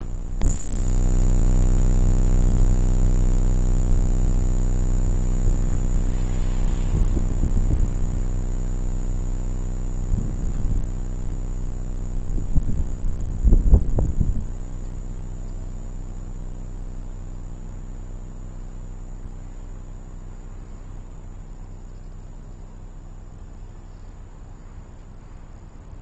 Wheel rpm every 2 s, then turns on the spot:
0, 0, 0, 0, 0, 0, 0, 0, 0, 0, 0, 0, 0.
none